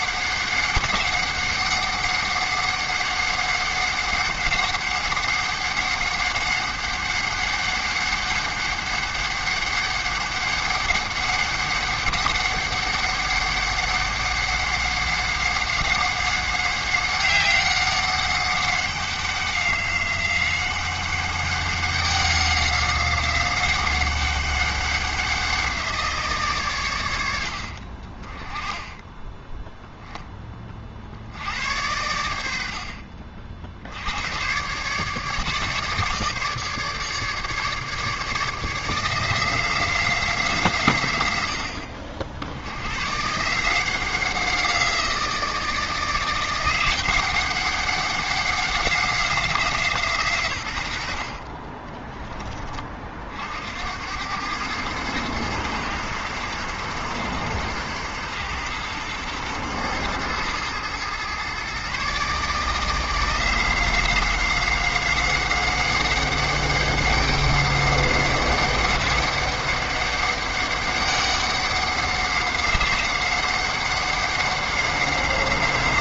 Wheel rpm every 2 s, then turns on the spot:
200, 200, 190, 200, 200, 200, 200, 200, 190, 190, 190, 190, 190, 120, 10, 50, 60, 130, 150, 160, 130, 110, 170, 180, 190, 90, 30, 110, 110, 110, 110, 160, 190, 200, 200, 200, 190, 190.
none